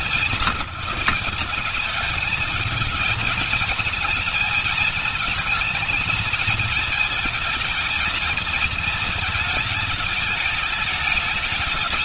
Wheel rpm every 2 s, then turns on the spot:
200, 220, 220, 220, 220, 210.
none